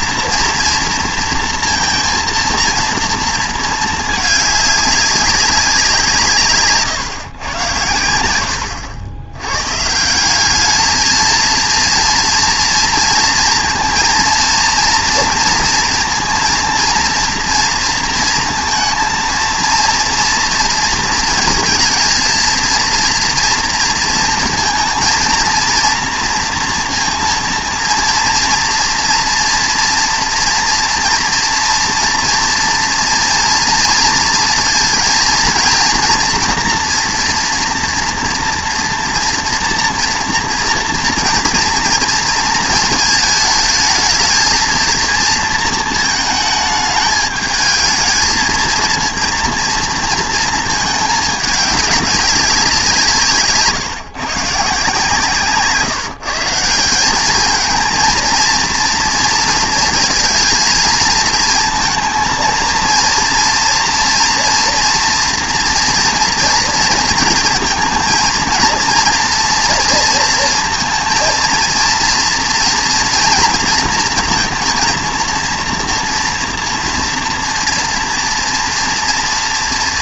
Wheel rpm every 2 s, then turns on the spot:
230, 230, 200, 140, 100, 220, 230, 230, 230, 230, 230, 230, 220, 230, 240, 230, 230, 230, 240, 240, 230, 230, 230, 220, 230, 220, 190, 140, 170, 230, 230, 230, 230, 230, 230, 230, 230, 230, 230, 230.
none